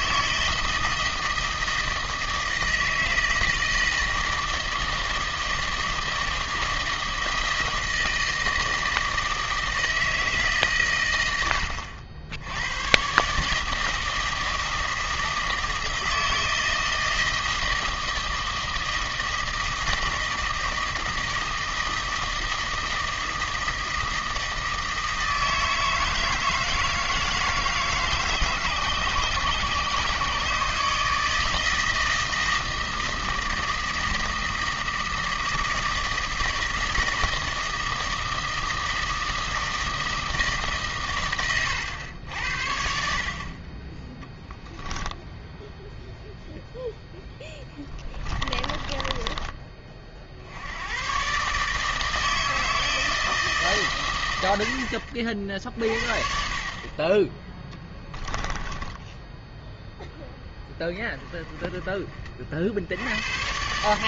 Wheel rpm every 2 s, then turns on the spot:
160, 160, 160, 160, 160, 130, 100, 160, 160, 160, 160, 160, 160, 160, 140, 150, 160, 160, 160, 160, 140, 60, 10, 0, 20, 80, 160, 80, 30, 10, 10, 60.
48-50 58-60